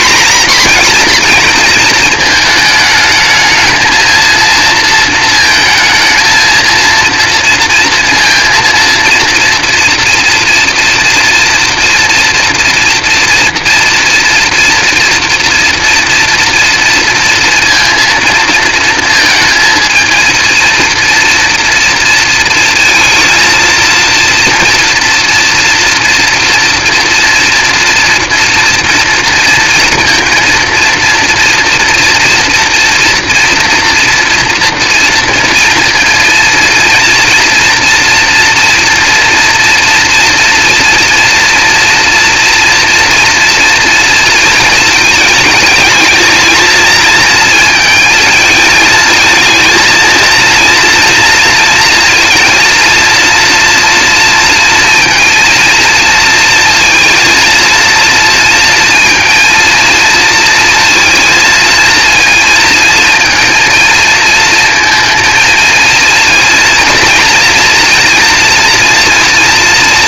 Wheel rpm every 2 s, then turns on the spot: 230, 220, 220, 230, 230, 230, 230, 240, 230, 230, 230, 230, 230, 230, 230, 230, 240, 230, 230, 230, 230, 230, 220, 220, 220, 230, 230, 230, 230, 230, 230, 230, 220, 230, 230.
none